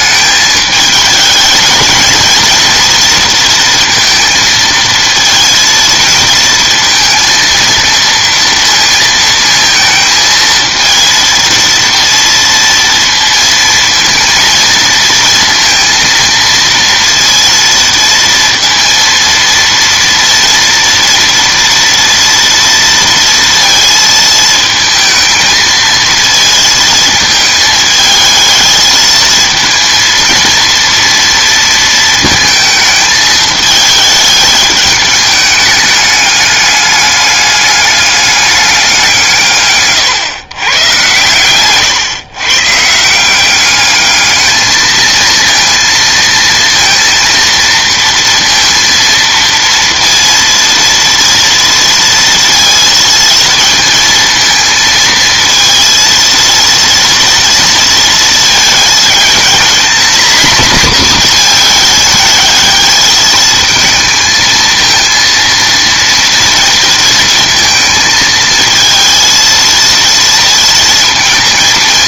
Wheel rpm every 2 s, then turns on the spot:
220, 230, 220, 230, 230, 220, 230, 230, 230, 230, 230, 230, 220, 220, 220, 230, 220, 210, 200, 200, 120, 130, 220, 230, 230, 230, 230, 230, 230, 220, 230, 220, 230, 230, 220, 230.
none